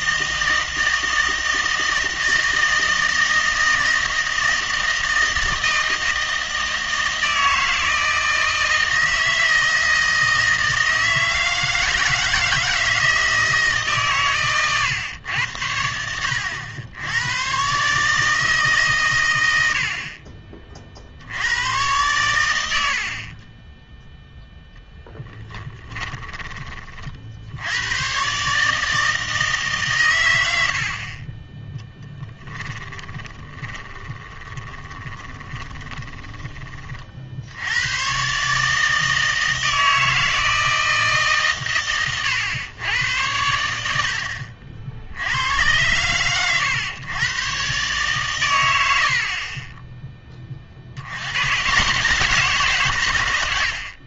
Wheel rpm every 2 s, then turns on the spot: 160, 160, 160, 160, 160, 160, 160, 120, 80, 150, 40, 80, 0, 30, 150, 80, 10, 20, 30, 150, 160, 110, 70, 110, 100, 50, 150.
32-36